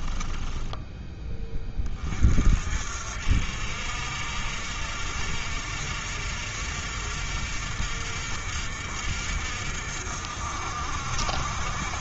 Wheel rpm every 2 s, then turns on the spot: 10, 50, 60, 60, 60, 60.
none